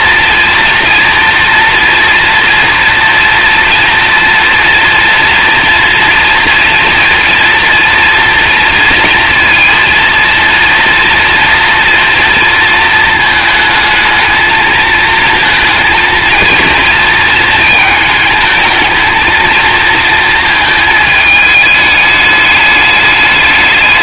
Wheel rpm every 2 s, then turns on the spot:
230, 230, 230, 230, 230, 230, 230, 230, 230, 220, 220, 210.
none